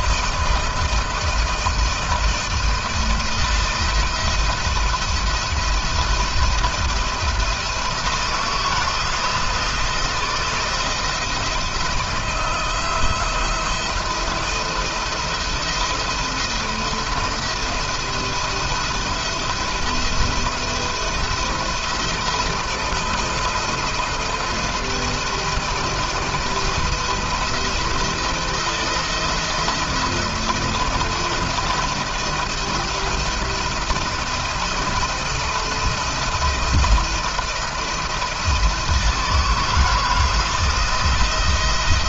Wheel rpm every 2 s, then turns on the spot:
170, 170, 170, 170, 170, 170, 170, 170, 170, 170, 170, 160, 170, 170, 160, 170, 170, 170, 170, 160, 170.
none